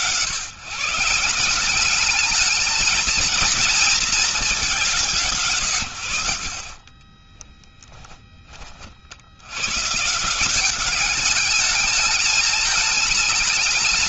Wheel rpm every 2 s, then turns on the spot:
150, 220, 200, 50, 40, 180, 210.
none